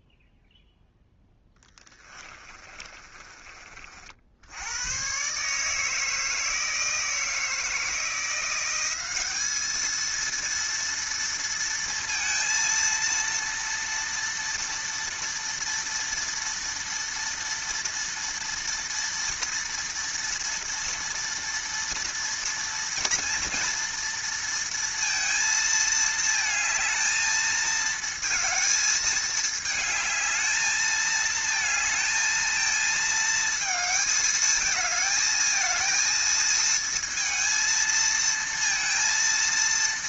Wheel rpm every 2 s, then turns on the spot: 10, 30, 130, 160, 200, 230, 230, 230, 230, 230, 230, 230, 230, 220, 220, 220, 220, 220, 230, 230.
0-4